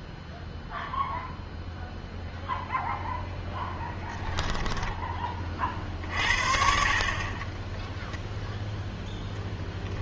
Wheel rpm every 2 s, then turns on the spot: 0, 0, 10, 50, 0.
4-6